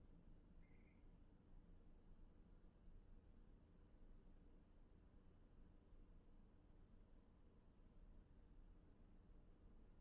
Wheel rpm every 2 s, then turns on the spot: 0, 0, 0, 0, 0.
none